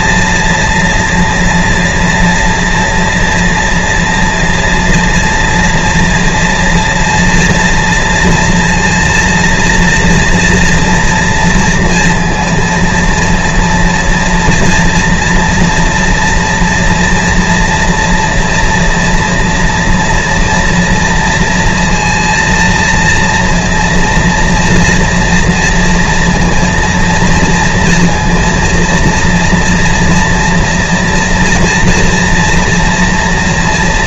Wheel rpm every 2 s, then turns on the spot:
230, 230, 230, 230, 230, 230, 230, 230, 240, 230, 230, 230, 230, 230, 230, 230, 230.
none